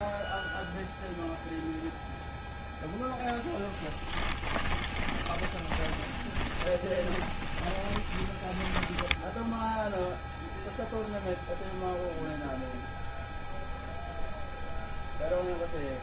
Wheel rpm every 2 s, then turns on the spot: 0, 0, 10, 20, 10, 0, 0, 0.
4-10